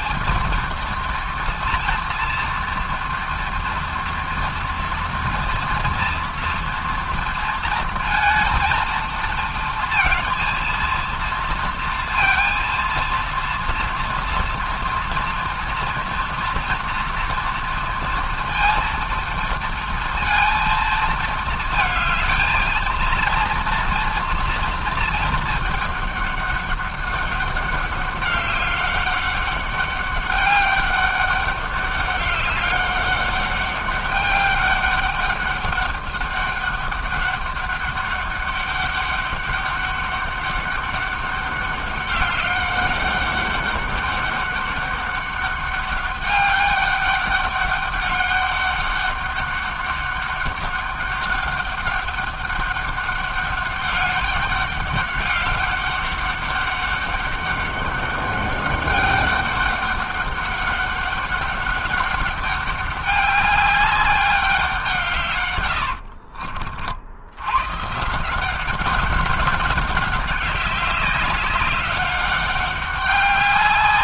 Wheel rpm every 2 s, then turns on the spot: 230, 240, 230, 240, 230, 230, 230, 230, 230, 230, 230, 230, 230, 200, 200, 200, 200, 200, 200, 200, 200, 200, 200, 200, 200, 200, 200, 200, 200, 200, 200, 200, 190, 50, 180, 200, 200.
none